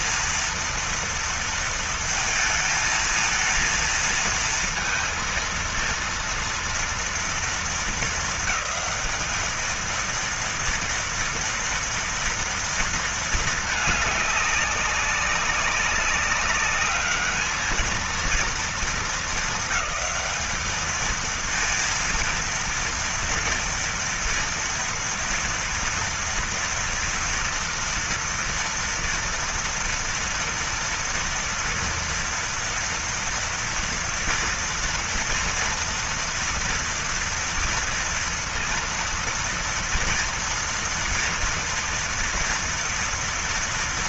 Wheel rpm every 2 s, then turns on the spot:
230, 220, 230, 230, 220, 230, 230, 200, 200, 220, 210, 230, 240, 240, 240, 230, 230, 230, 240, 230, 230, 230.
none